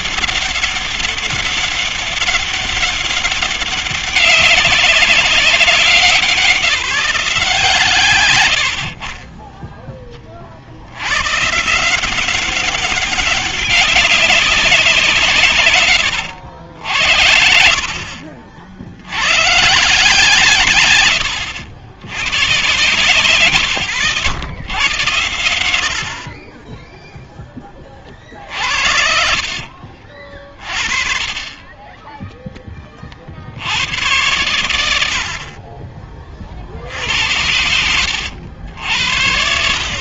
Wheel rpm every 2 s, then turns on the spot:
200, 200, 200, 190, 90, 60, 200, 190, 80, 100, 110, 130, 120, 10, 60, 40, 20, 80, 50, 80.
28-30 36-38